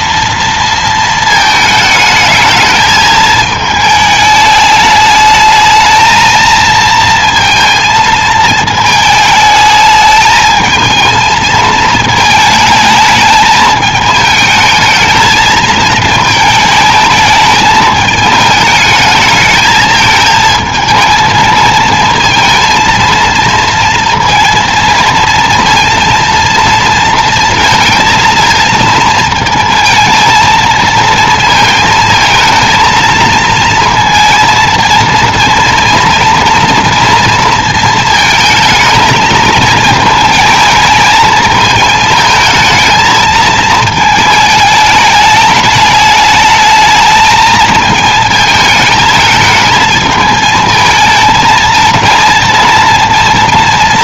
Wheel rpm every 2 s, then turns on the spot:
230, 220, 210, 230, 220, 220, 220, 220, 220, 220, 220, 230, 230, 230, 230, 220, 220, 230, 230, 220, 220, 220, 220, 220, 220, 220, 230.
none